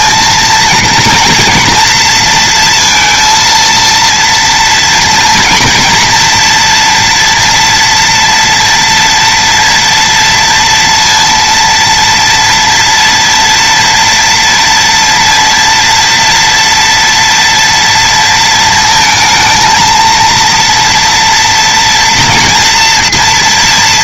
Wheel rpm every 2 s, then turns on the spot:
230, 230, 230, 230, 240, 230, 230, 230, 230, 220, 230, 230.
none